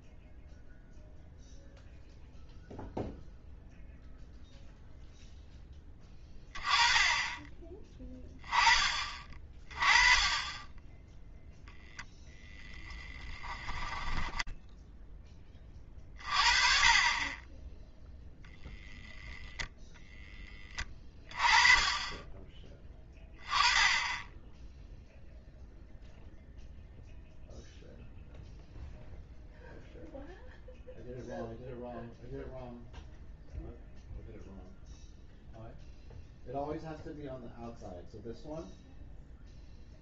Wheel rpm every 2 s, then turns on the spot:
0, 0, 0, 20, 20, 20, 0, 0, 30, 0, 10, 20, 0, 0, 0, 0, 0, 0, 0, 0.
none